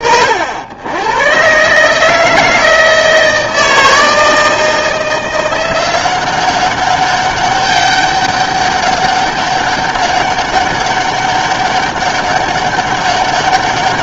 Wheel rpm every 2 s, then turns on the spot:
100, 160, 160, 190, 200, 200, 200.
none